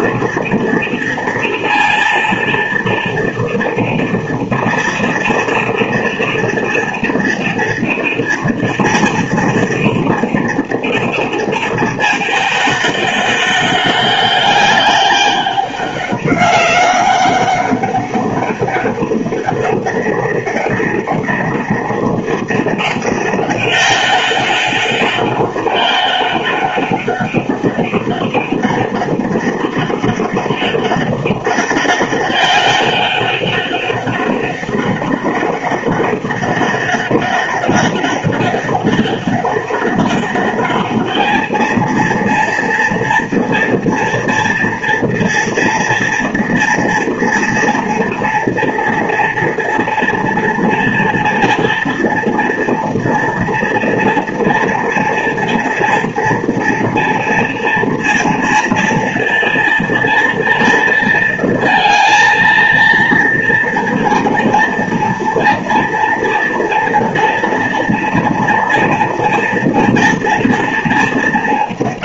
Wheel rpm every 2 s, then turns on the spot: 230, 230, 230, 230, 230, 230, 210, 200, 200, 200, 200, 200, 190, 200, 200, 200, 200, 200, 200, 200, 200, 230, 230, 230, 230, 230, 240, 240, 230, 230, 230, 230, 230, 230, 240, 230.
none